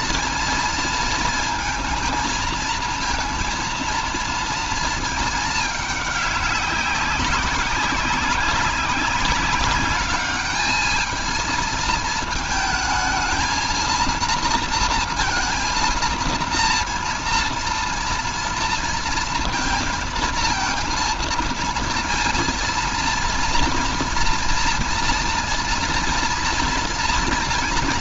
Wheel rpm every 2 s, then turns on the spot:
230, 230, 230, 190, 190, 220, 220, 230, 230, 230, 220, 230, 240, 240.
none